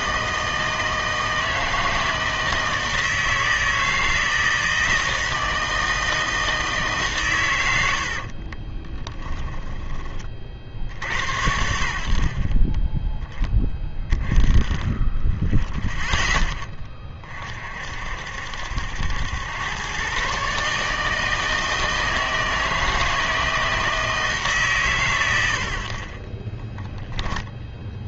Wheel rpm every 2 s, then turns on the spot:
160, 160, 160, 160, 30, 60, 30, 20, 10, 70, 140, 160, 150, 20.
8-10 26-28